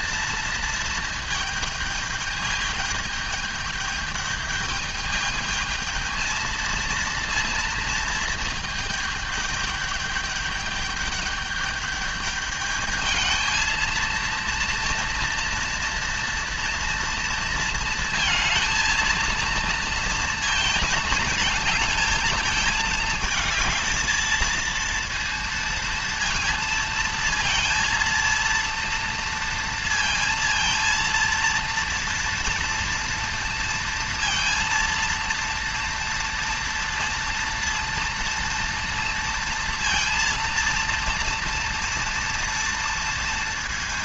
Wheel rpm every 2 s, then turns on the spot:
230, 210, 210, 230, 220, 210, 210, 230, 230, 230, 220, 220, 230, 230, 230, 230, 230, 230, 230, 230, 230, 230.
none